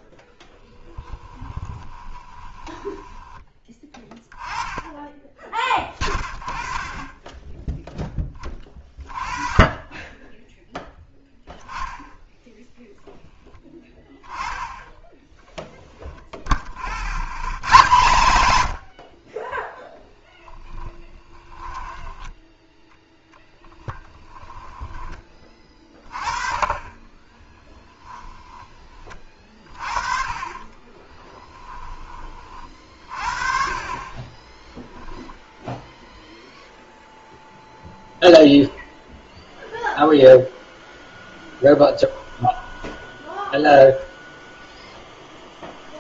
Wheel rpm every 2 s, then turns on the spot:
10, 10, 10, 20, 20, 0, 0, 10, 50, 70, 10, 0, 10, 20, 20, 30, 40, 10, 0, 0, 0, 10, 0.
0-4 16-22 26-28 30-32 34-36 42-44